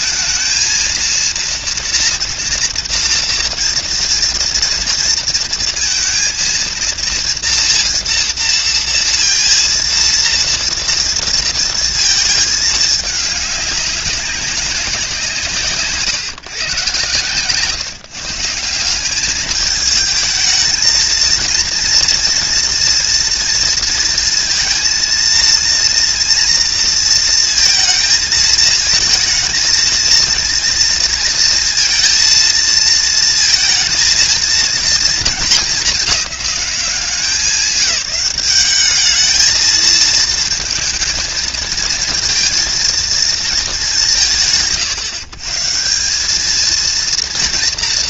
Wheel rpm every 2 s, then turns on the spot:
230, 230, 230, 230, 230, 230, 220, 190, 130, 170, 220, 230, 230, 230, 220, 230, 230, 230, 200, 200, 220, 230, 100, 210.
none